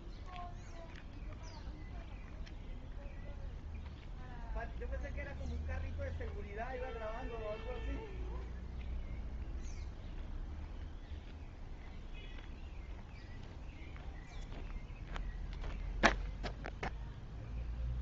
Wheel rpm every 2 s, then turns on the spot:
0, 0, 0, 0, 0, 0, 0, 0, 0.
none